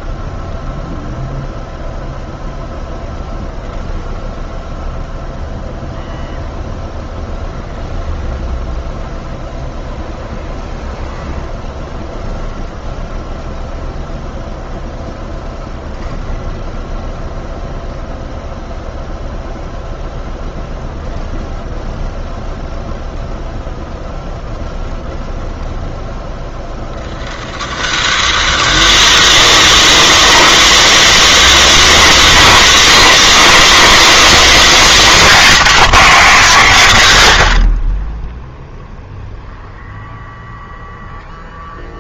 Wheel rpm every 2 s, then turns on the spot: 0, 0, 20, 100, 90, 110, 0, 0, 0, 0, 0, 0, 0, 0, 0, 150, 70, 60, 0, 40, 300.
8-10 32-34